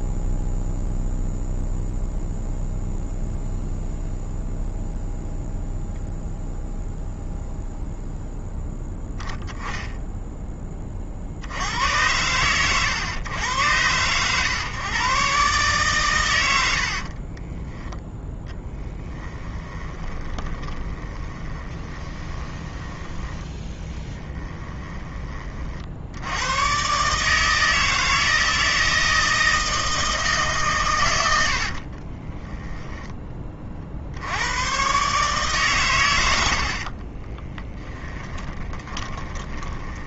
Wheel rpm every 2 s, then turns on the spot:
0, 0, 0, 0, 0, 20, 110, 120, 80, 20, 20, 10, 10, 120, 160, 130, 10, 110, 80, 30.
16-26 32-34 36-40